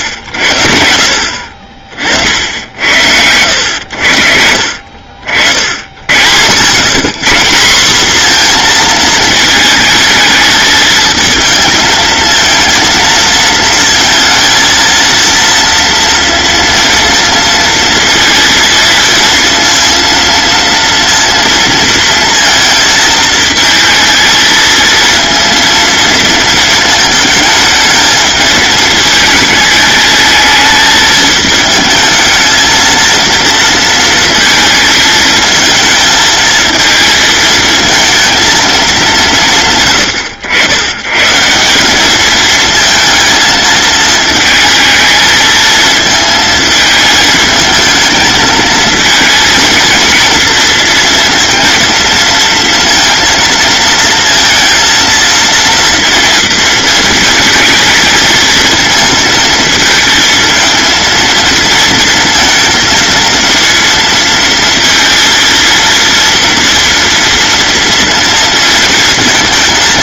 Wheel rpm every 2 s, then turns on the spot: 90, 80, 60, 90, 230, 220, 220, 230, 230, 230, 230, 230, 230, 230, 220, 220, 220, 230, 220, 220, 100, 220, 220, 220, 220, 230, 230, 230, 230, 220, 220, 230, 230, 230, 230.
none